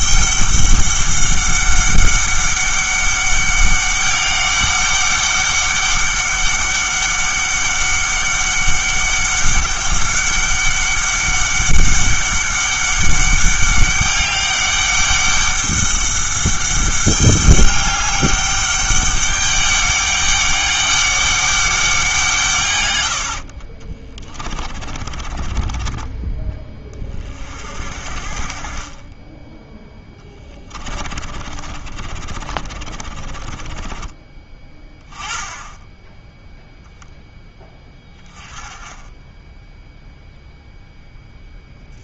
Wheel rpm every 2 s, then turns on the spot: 200, 200, 200, 200, 200, 200, 200, 200, 200, 200, 200, 120, 30, 30, 30, 30, 40, 20, 0, 20, 0.
24-26 30-34